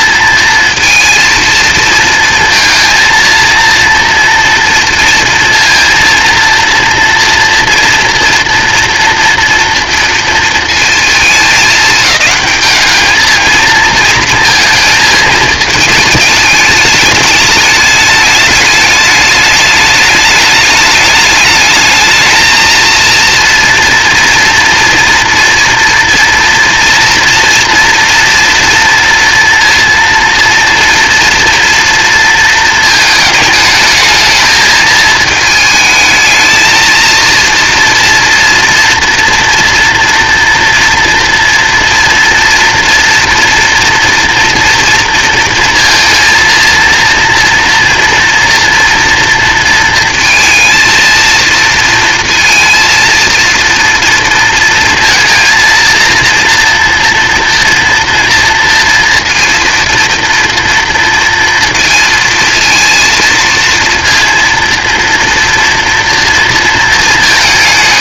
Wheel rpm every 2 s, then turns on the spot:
230, 230, 230, 230, 240, 230, 210, 220, 210, 210, 210, 220, 230, 230, 230, 230, 230, 220, 230, 230, 230, 230, 230, 230, 230, 230, 230, 230, 230, 230, 230, 230, 230, 230.
none